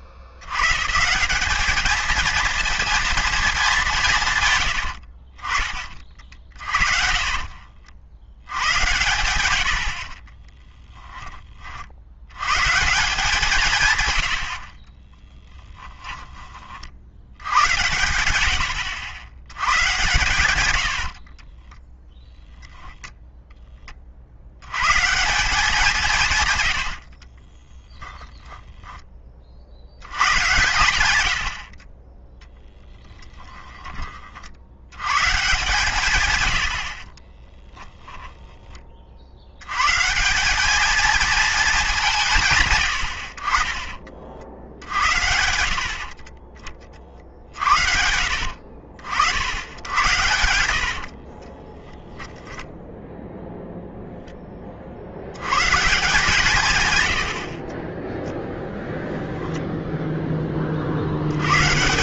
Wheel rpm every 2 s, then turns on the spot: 100, 230, 110, 50, 110, 10, 140, 50, 30, 80, 100, 0, 90, 120, 10, 90, 10, 60, 90, 20, 210, 130, 70, 30, 60, 90, 0, 30, 140, 0, 30.
4-12 14-16 26-28 32-34 36-38 50-52